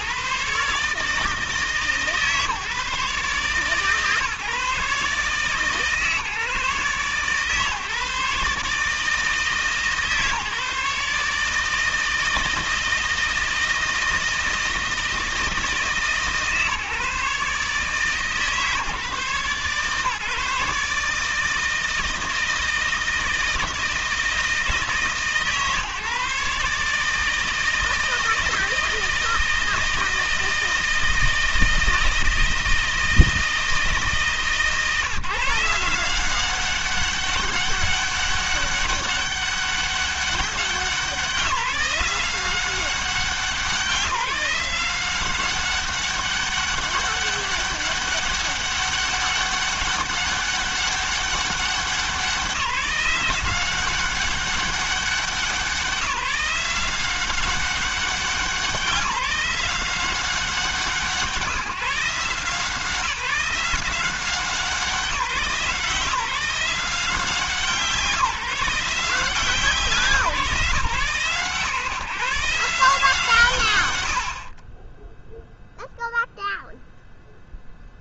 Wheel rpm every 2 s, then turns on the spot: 150, 150, 150, 140, 150, 150, 160, 160, 150, 150, 150, 160, 160, 150, 160, 160, 160, 150, 190, 200, 180, 180, 180, 200, 200, 200, 180, 200, 180, 190, 160, 160, 180, 170, 160, 140, 160, 30, 0.
none